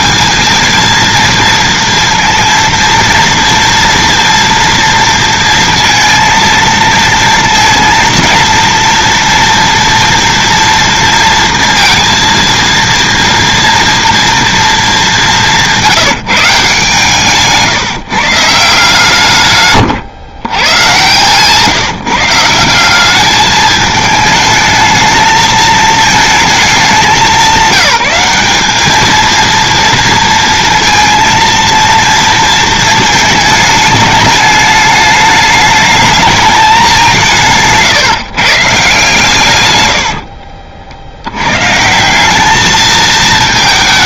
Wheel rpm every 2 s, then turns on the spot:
230, 230, 230, 230, 230, 230, 230, 230, 150, 160, 110, 170, 220, 220, 200, 230, 230, 210, 210, 140, 60, 210.
none